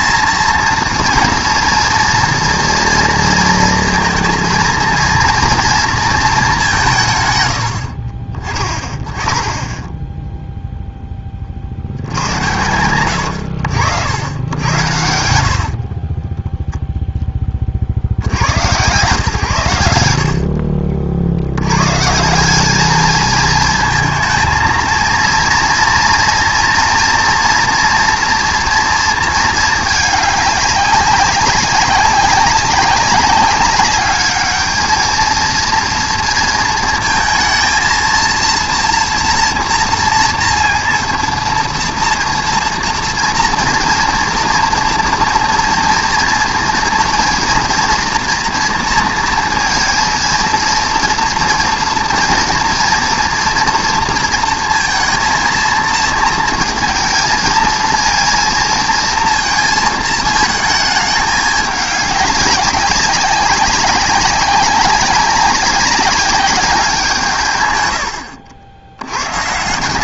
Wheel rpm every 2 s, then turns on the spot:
230, 230, 230, 200, 30, 0, 100, 100, 10, 110, 50, 200, 230, 240, 240, 210, 200, 210, 230, 230, 230, 230, 230, 230, 230, 230, 230, 230, 230, 230, 220, 200, 200, 190, 80.
16-18